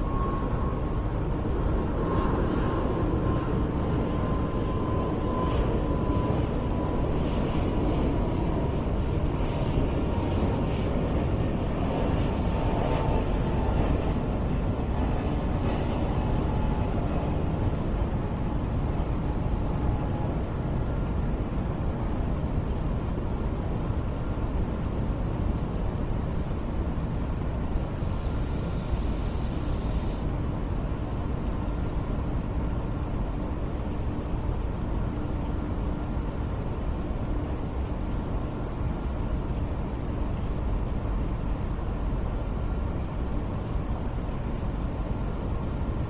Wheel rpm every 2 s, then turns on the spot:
0, 0, 0, 0, 0, 0, 0, 0, 0, 0, 0, 0, 0, 0, 0, 0, 0, 0, 0, 0, 0, 0, 0.
none